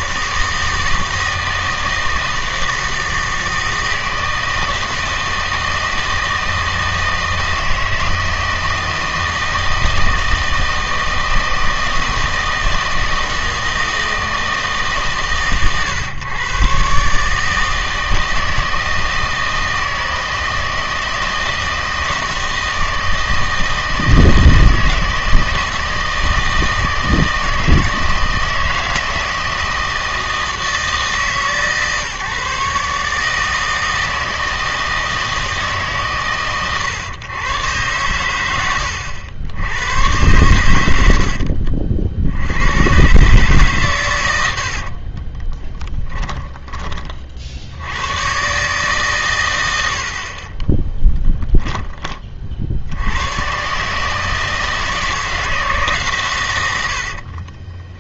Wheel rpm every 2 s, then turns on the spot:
160, 160, 160, 160, 160, 160, 160, 150, 120, 160, 160, 160, 160, 160, 160, 160, 140, 160, 120, 90, 90, 100, 70, 20, 140, 20, 70, 160, 90.
44-46 50-52